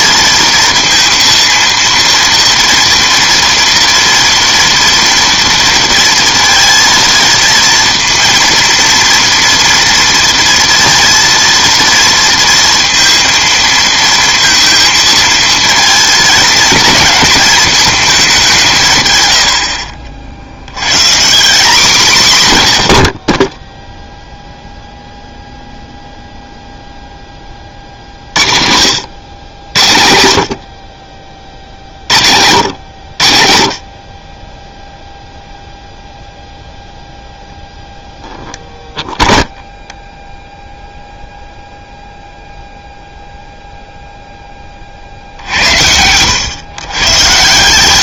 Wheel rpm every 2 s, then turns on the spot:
230, 230, 230, 230, 230, 230, 230, 220, 220, 120, 130, 110, 0, 0, 60, 60, 90, 10, 0, 0, 0, 0, 20, 110.
22-24